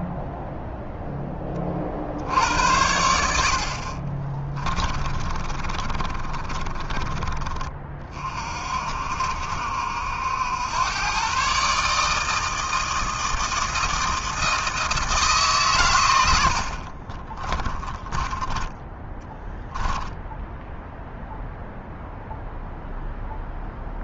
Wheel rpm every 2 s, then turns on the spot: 0, 80, 30, 30, 50, 90, 160, 160, 70, 20, 0, 0.
4-8 16-20